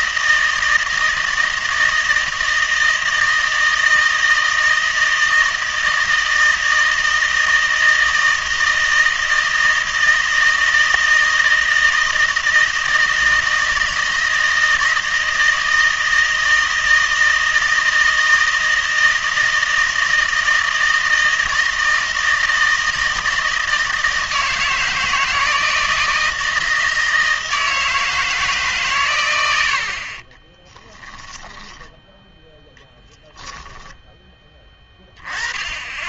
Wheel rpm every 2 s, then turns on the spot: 160, 160, 160, 160, 160, 160, 160, 160, 160, 160, 160, 160, 160, 160, 140, 10, 0, 20.
30-32